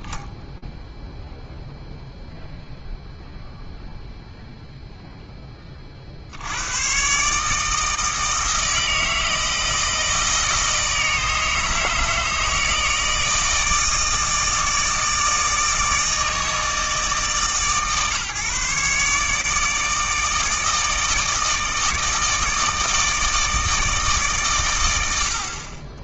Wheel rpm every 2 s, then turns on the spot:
0, 0, 0, 90, 160, 160, 160, 160, 160, 140, 160, 160, 90.
none